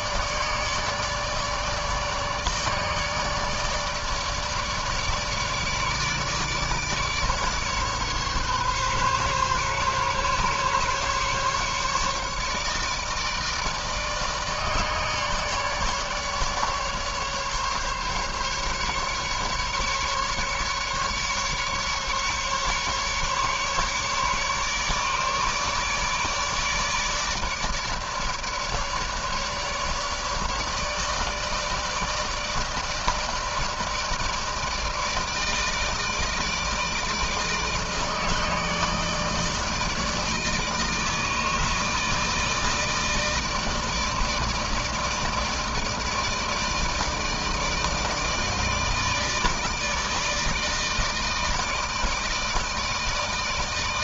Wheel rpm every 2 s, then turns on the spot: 150, 150, 150, 150, 140, 140, 150, 150, 150, 140, 140, 150, 150, 150, 150, 150, 160, 160, 160, 160, 160, 160, 160, 160, 160, 160, 160.
none